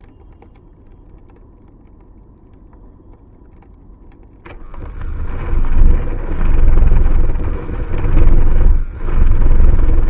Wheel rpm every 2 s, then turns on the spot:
0, 0, 20, 20, 20.
4-10